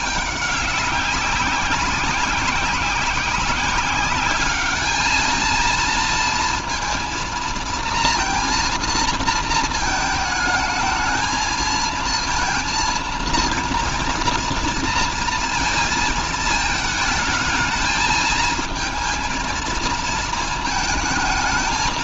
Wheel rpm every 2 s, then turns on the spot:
200, 190, 210, 230, 230, 220, 230, 230, 220, 230, 220.
none